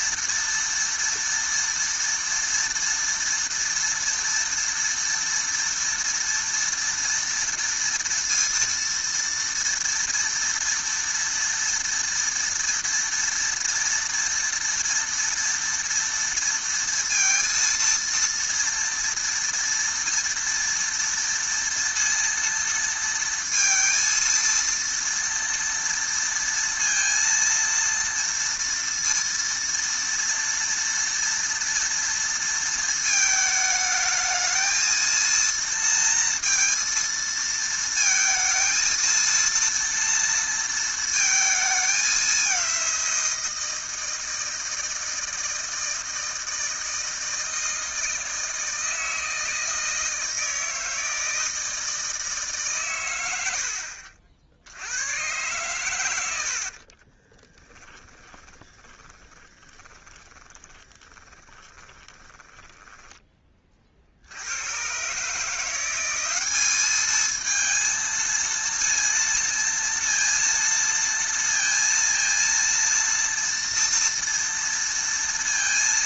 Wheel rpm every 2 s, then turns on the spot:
230, 230, 230, 240, 230, 230, 230, 230, 230, 230, 230, 230, 230, 230, 230, 230, 230, 220, 230, 230, 230, 190, 160, 160, 160, 160, 140, 80, 70, 20, 20, 10, 90, 200, 230, 230, 230, 230.
56-64